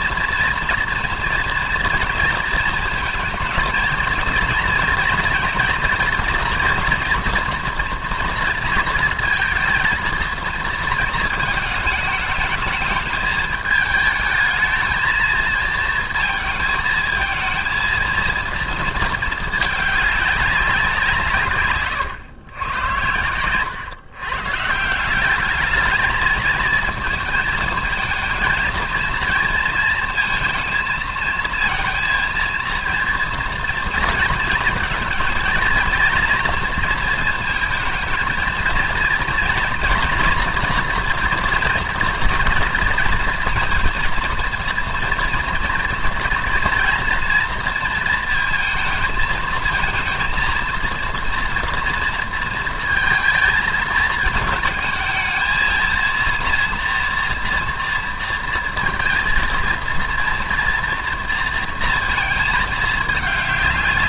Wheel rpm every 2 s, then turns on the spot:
230, 220, 230, 240, 230, 230, 210, 220, 220, 220, 180, 100, 160, 220, 230, 220, 230, 220, 230, 230, 230, 230, 230, 230, 220, 230, 230, 220, 230, 230, 230, 220.
none